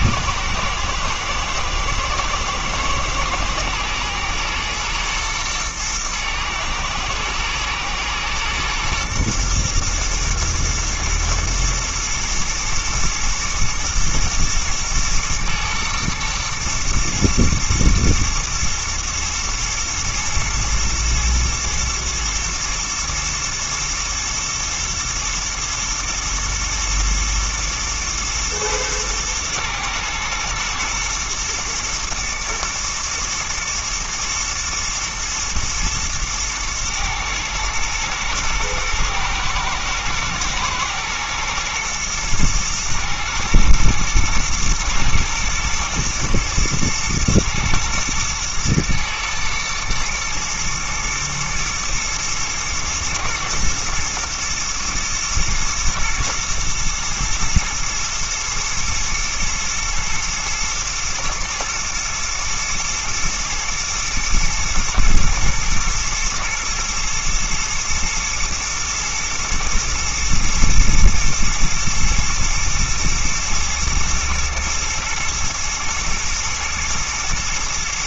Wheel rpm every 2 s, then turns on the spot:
110, 110, 120, 110, 120, 120, 110, 110, 110, 110, 120, 110, 110, 110, 110, 110, 120, 120, 110, 110, 110, 120, 110, 120, 110, 110, 120, 120, 110, 120, 110, 120, 120, 110, 110, 110, 110, 120, 110.
none